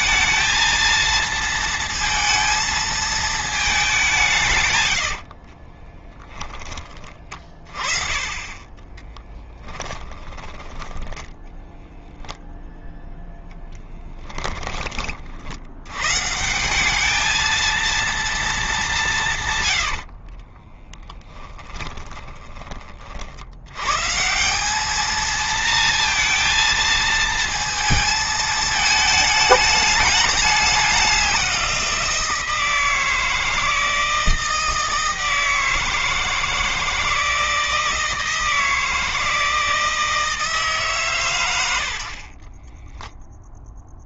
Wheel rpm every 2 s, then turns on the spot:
220, 220, 160, 20, 20, 10, 0, 20, 170, 210, 30, 40, 180, 230, 220, 200, 170, 160, 160, 160, 160, 40.
4-6 20-22 42-44